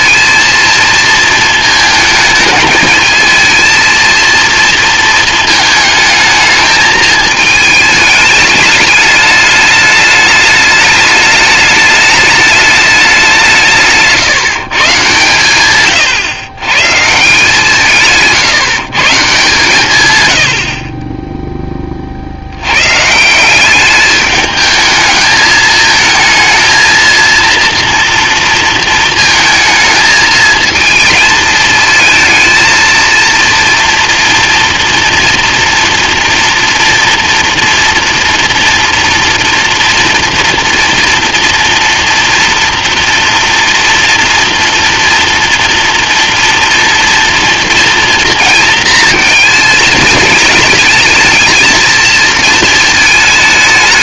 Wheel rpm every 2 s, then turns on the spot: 230, 220, 230, 220, 210, 210, 210, 160, 120, 150, 70, 110, 210, 230, 230, 220, 230, 240, 230, 230, 230, 230, 230, 240, 230, 210, 230.
none